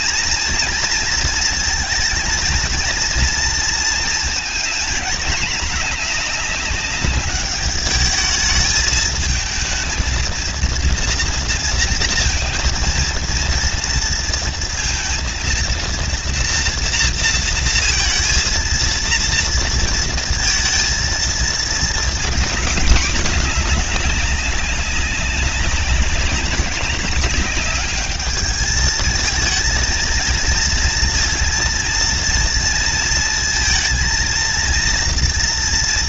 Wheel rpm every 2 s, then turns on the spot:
230, 230, 230, 210, 210, 230, 230, 230, 230, 230, 230, 230, 200, 200, 210, 230, 230, 230.
none